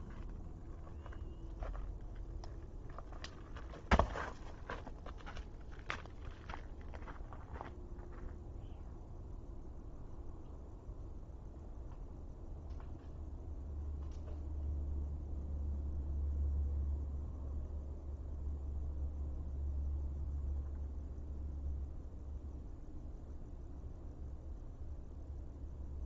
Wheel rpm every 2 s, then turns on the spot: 0, 0, 0, 0, 0, 0, 0, 0, 0, 0, 0, 0, 0.
none